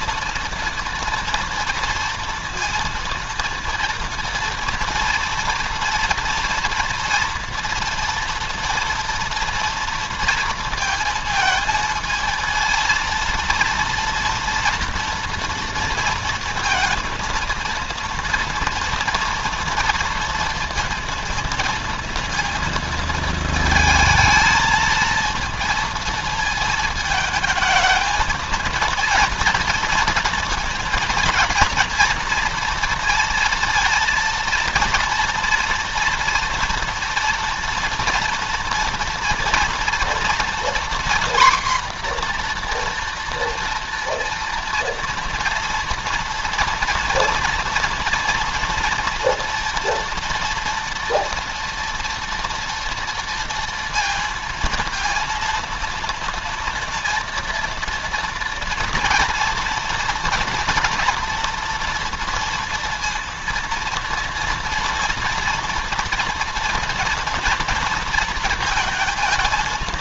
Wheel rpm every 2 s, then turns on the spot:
230, 230, 230, 230, 230, 230, 230, 230, 230, 230, 230, 230, 230, 220, 220, 230, 230, 230, 230, 240, 240, 240, 230, 230, 230, 230, 230, 230, 230, 230, 230, 230, 230, 230, 220.
none